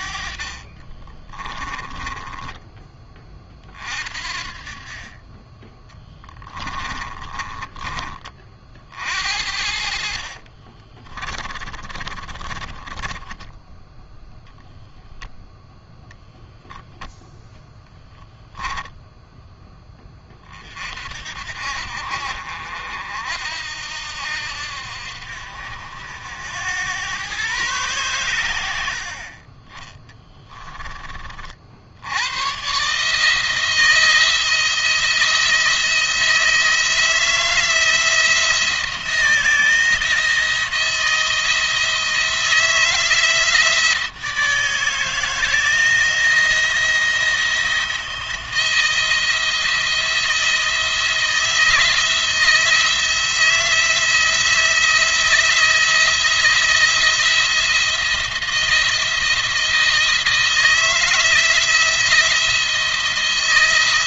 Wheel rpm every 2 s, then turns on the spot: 40, 20, 40, 20, 40, 30, 20, 0, 0, 0, 40, 60, 70, 90, 90, 20, 130, 170, 160, 170, 170, 160, 160, 170, 170, 170, 170, 170, 170, 170, 160, 160.
0-2 6-8 10-14